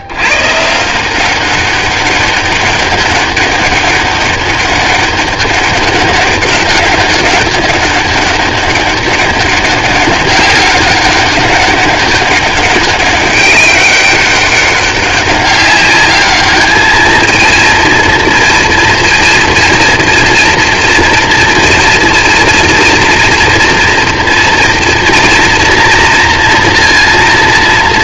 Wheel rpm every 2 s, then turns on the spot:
100, 190, 200, 200, 200, 200, 200, 200, 210, 240, 230, 230, 240, 240.
none